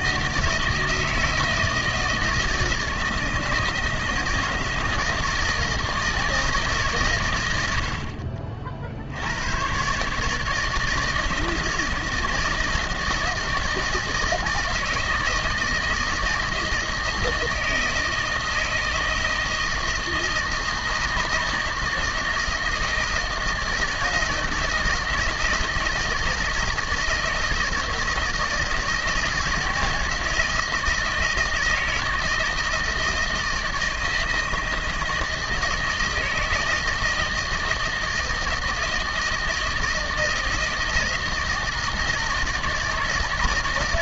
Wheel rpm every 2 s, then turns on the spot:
160, 160, 160, 160, 50, 160, 160, 160, 160, 160, 160, 160, 160, 160, 160, 160, 160, 160, 160, 160, 160, 160.
none